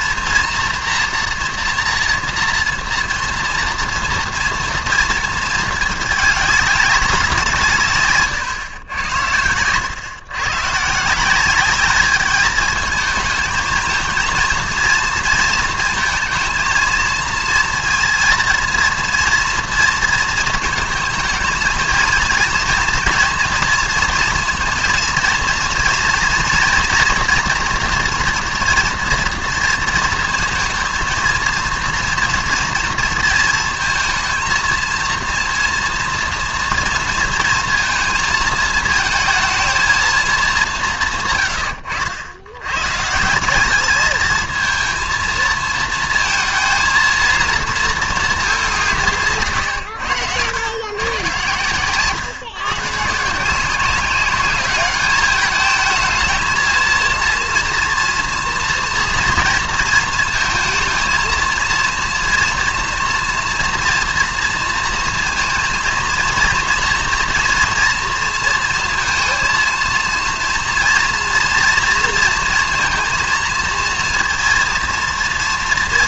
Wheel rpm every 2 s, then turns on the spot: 240, 230, 230, 200, 120, 140, 220, 230, 230, 230, 220, 230, 230, 230, 230, 230, 230, 230, 230, 220, 190, 110, 220, 230, 190, 120, 130, 200, 220, 230, 230, 240, 230, 230, 230, 230, 230, 230.
8-10